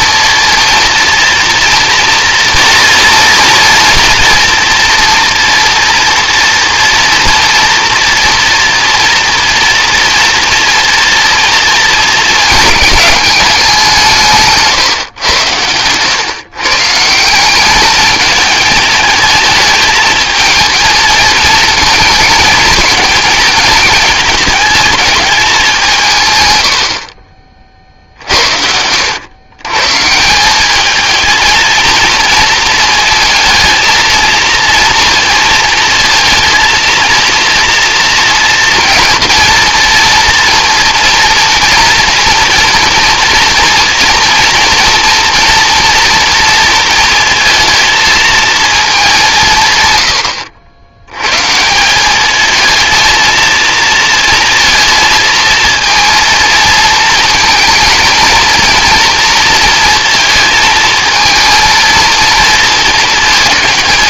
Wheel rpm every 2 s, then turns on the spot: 230, 230, 230, 230, 230, 230, 210, 150, 140, 220, 220, 220, 210, 100, 70, 190, 230, 230, 220, 230, 230, 230, 230, 230, 220, 80, 220, 230, 230, 230, 230, 230.
none